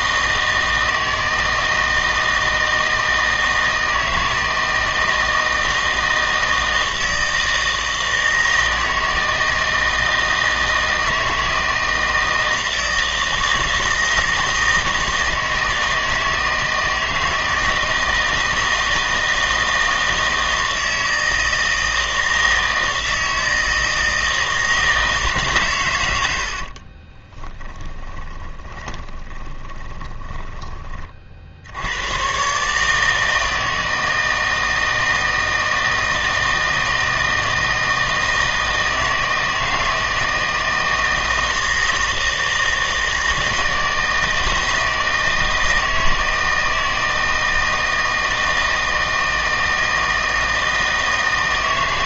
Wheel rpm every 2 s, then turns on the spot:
160, 160, 160, 160, 160, 160, 160, 160, 160, 160, 160, 160, 160, 40, 20, 20, 150, 160, 160, 160, 160, 160, 160, 160, 160, 160.
26-30